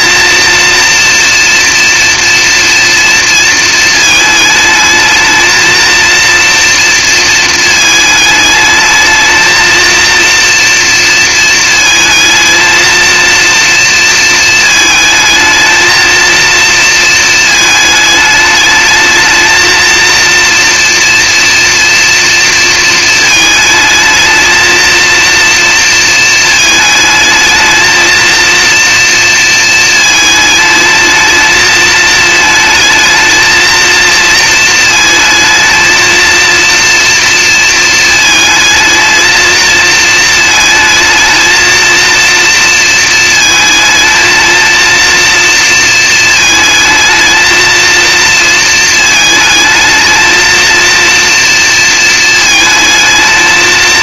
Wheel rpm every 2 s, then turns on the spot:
230, 230, 220, 230, 220, 230, 230, 220, 230, 210, 230, 230, 220, 220, 230, 220, 220, 230, 230, 220, 220, 230, 230, 220, 230, 230, 220.
none